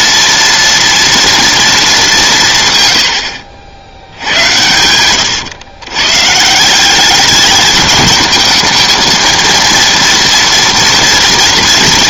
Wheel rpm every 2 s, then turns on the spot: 230, 130, 110, 180, 220, 230.
none